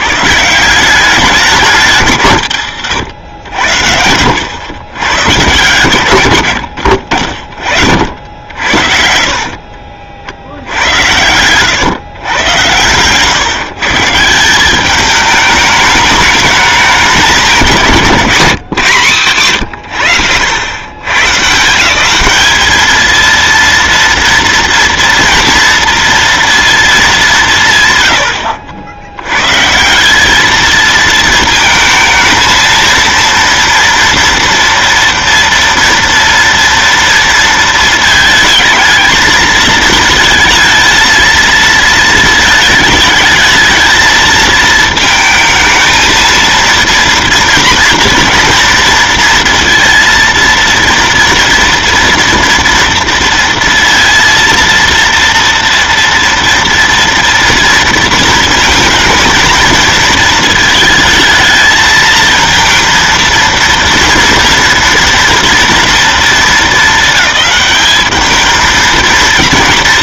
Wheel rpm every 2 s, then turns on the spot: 150, 130, 100, 90, 70, 70, 120, 190, 210, 180, 100, 200, 230, 230, 80, 220, 230, 230, 230, 220, 230, 220, 220, 230, 230, 230, 230, 230, 230, 230, 230, 230, 230, 220, 220.
8-10